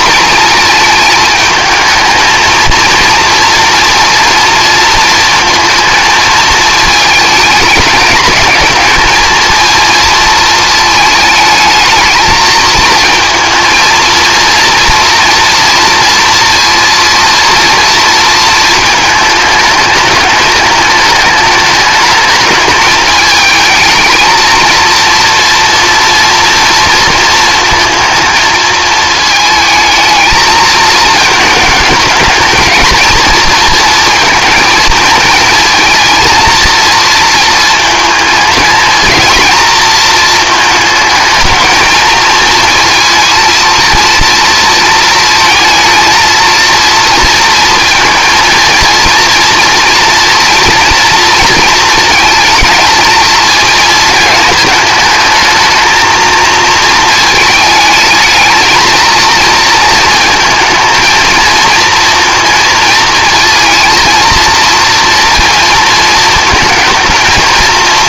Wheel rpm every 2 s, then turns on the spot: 230, 230, 230, 220, 220, 220, 230, 230, 230, 220, 210, 210, 230, 230, 220, 220, 230, 220, 230, 220, 220, 230, 230, 230, 230, 230, 220, 210, 220, 220, 230, 230, 230, 220.
none